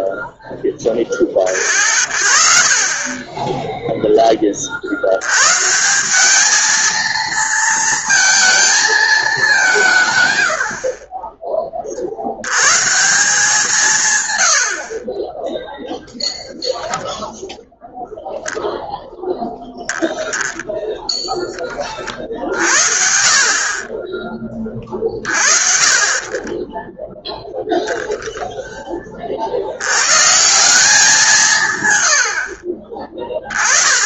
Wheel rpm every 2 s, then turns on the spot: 30, 30, 200, 230, 100, 90, 130, 0, 0, 0, 40, 60, 60, 10, 110, 130, 10.
24-28 32-34